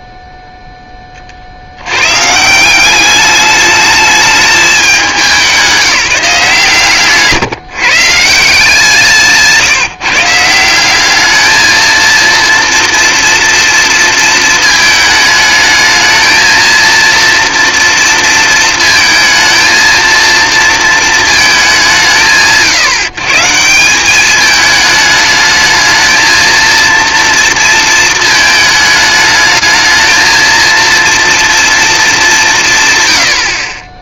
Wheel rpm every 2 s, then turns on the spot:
40, 200, 190, 140, 170, 200, 230, 220, 230, 230, 230, 140, 210, 230, 210, 230, 100.
none